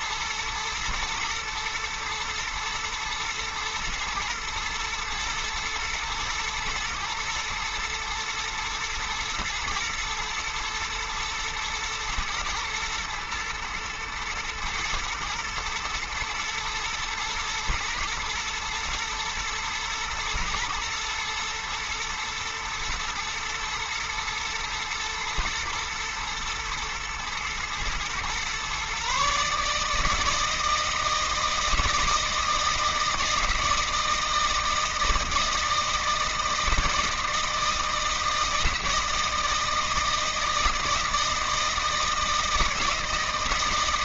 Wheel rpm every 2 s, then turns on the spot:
120, 110, 110, 110, 110, 120, 120, 110, 120, 120, 110, 110, 110, 110, 130, 160, 160, 160, 160, 160, 160, 160.
none